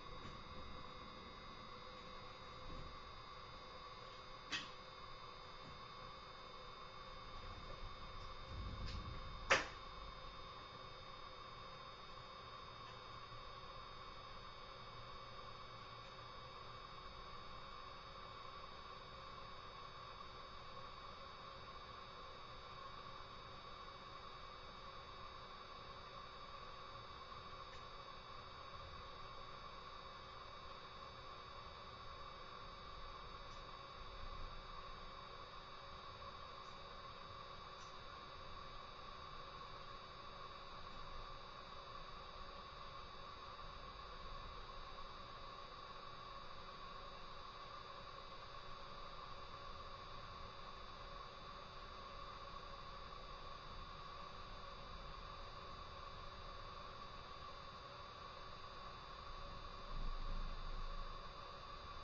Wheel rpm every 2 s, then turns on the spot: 0, 0, 0, 0, 0, 0, 0, 0, 0, 0, 0, 0, 0, 0, 0, 0, 0, 0, 0, 0, 0, 0, 0, 0, 0, 0, 0, 0, 0, 0, 0.
none